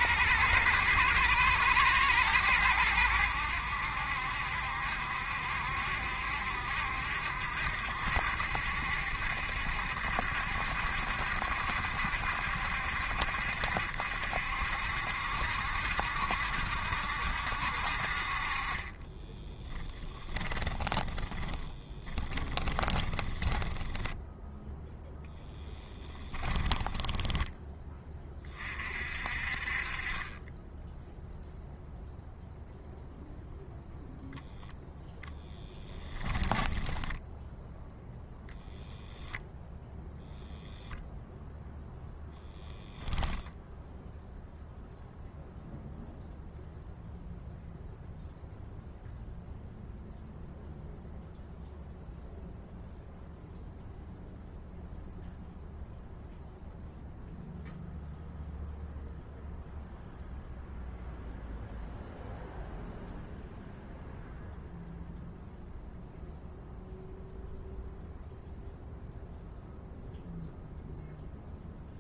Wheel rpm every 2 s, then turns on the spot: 110, 100, 70, 70, 70, 70, 70, 70, 70, 30, 20, 30, 0, 10, 40, 10, 0, 10, 10, 0, 0, 0, 0, 0, 0, 0, 0, 0, 0, 0, 0, 0, 0, 0, 0, 0.
18-24 26-28 36-38